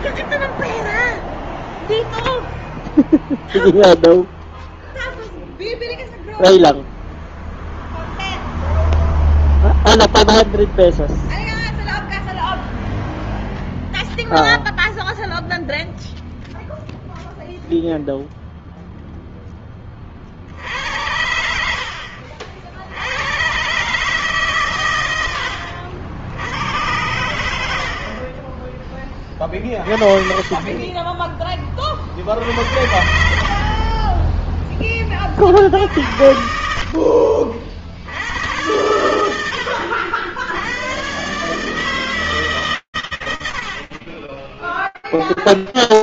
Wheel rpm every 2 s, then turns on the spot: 0, 0, 0, 0, 0, 0, 0, 0, 0, 0, 60, 60, 140, 80, 30, 40, 40, 20, 60, 100, 80, 140, 20.
none